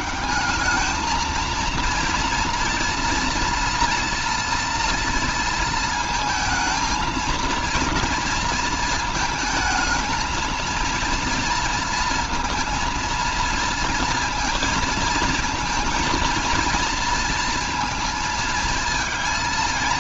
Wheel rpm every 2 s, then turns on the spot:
220, 230, 240, 220, 230, 230, 230, 230, 230, 220.
none